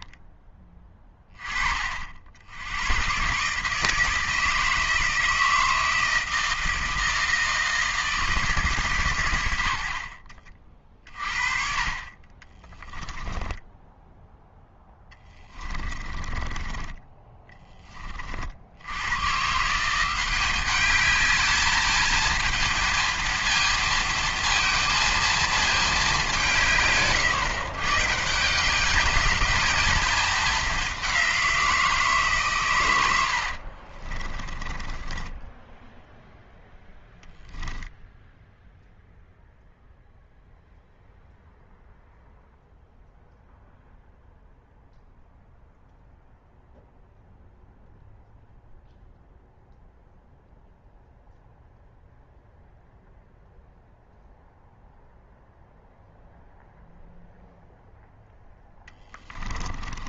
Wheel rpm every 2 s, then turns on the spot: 10, 100, 160, 160, 140, 40, 20, 10, 10, 80, 200, 230, 230, 150, 200, 200, 110, 20, 0, 0, 0, 0, 0, 0, 0, 0, 0, 0, 0, 10.
12-14 34-36 58-60